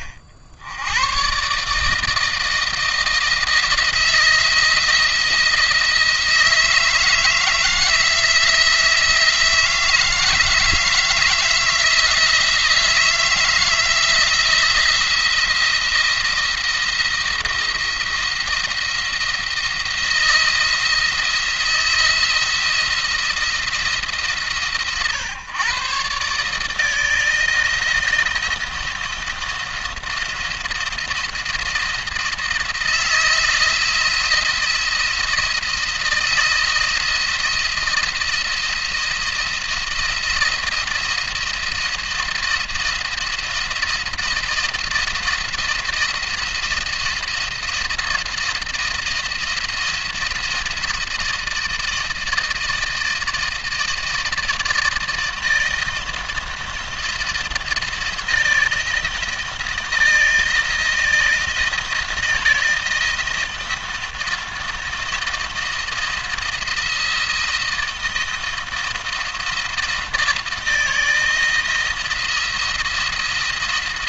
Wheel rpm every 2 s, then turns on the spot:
80, 160, 170, 160, 160, 160, 170, 170, 170, 170, 170, 170, 140, 150, 170, 170, 170, 170, 160, 170, 170, 170, 170, 170, 170, 160, 160, 160, 170, 170, 170, 160, 170, 170, 170, 170, 170.
none